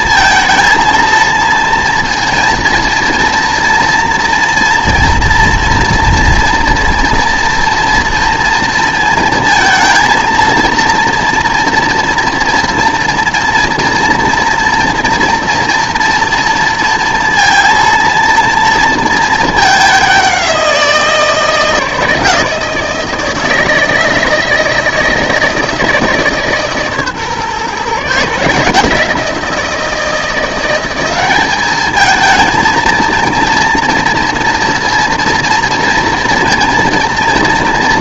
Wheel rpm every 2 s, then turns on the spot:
230, 230, 230, 230, 230, 230, 230, 230, 230, 230, 180, 160, 160, 140, 160, 180, 230, 230, 230.
none